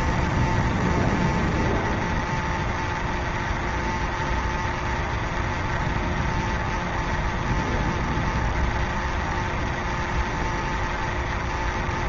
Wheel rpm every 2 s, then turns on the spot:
0, 0, 0, 0, 0, 0.
none